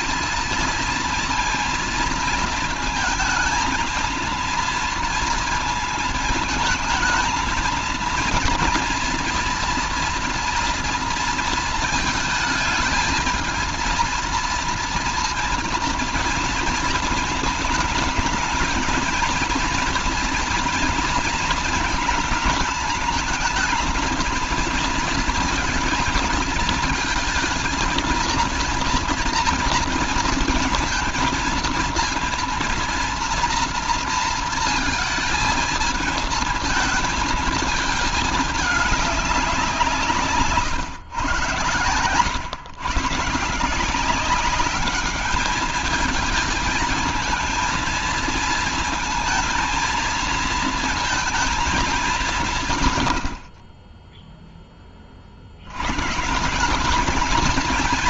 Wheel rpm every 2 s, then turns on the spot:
230, 220, 220, 220, 230, 230, 220, 230, 220, 230, 230, 220, 230, 230, 230, 230, 230, 220, 220, 200, 130, 150, 210, 230, 230, 230, 80, 50, 220.
none